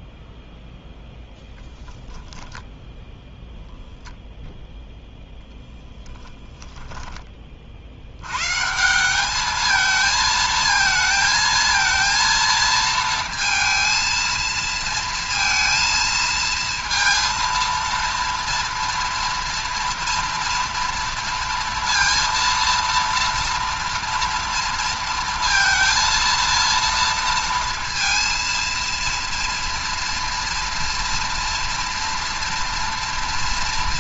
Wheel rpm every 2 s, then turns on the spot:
0, 0, 0, 10, 180, 230, 230, 230, 230, 230, 230, 230, 230, 230, 230, 230, 240.
none